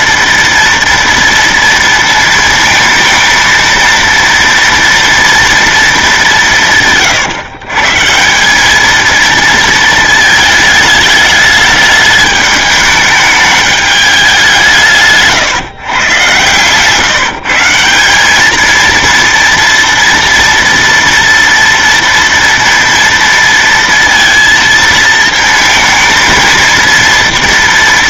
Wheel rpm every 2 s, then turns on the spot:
240, 230, 230, 180, 180, 220, 210, 180, 130, 210, 230, 230, 230, 220.
16-18